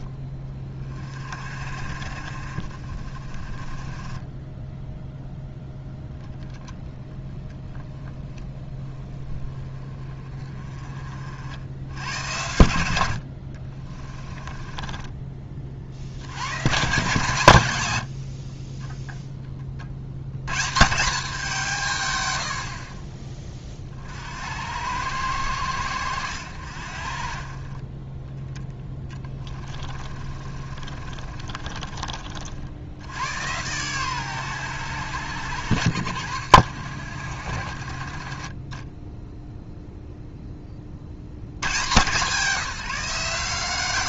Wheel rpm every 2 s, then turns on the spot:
30, 30, 0, 10, 10, 40, 90, 20, 130, 20, 160, 40, 80, 60, 10, 40, 40, 100, 70, 10, 100, 170.
14-16 28-32